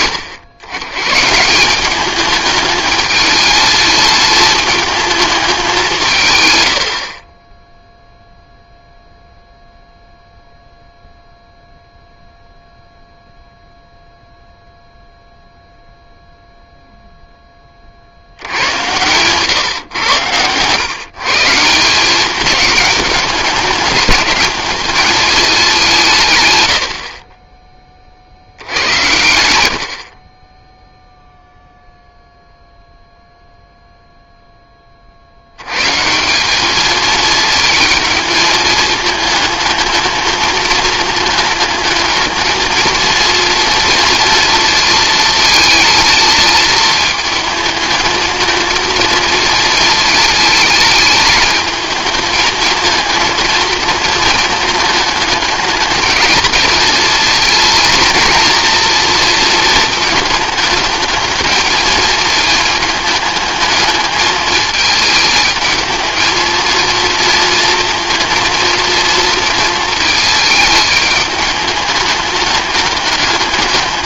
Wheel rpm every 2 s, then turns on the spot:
90, 210, 220, 60, 0, 0, 0, 0, 0, 110, 120, 210, 210, 80, 90, 0, 0, 30, 220, 220, 220, 230, 230, 220, 220, 220, 220, 220, 220, 230, 220, 210, 220, 230, 230, 210, 210.
none